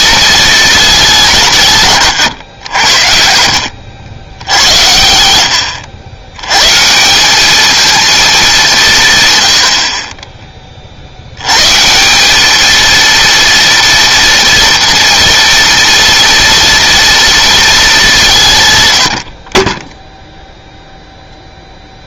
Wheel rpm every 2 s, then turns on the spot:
210, 90, 80, 140, 190, 30, 220, 230, 230, 110, 0.
none